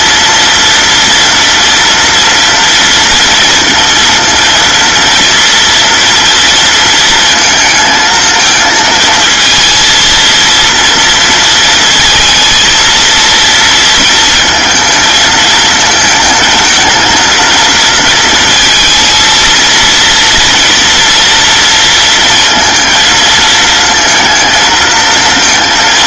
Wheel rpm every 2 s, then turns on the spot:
230, 230, 230, 230, 230, 230, 230, 220, 220, 230, 230, 230, 220.
none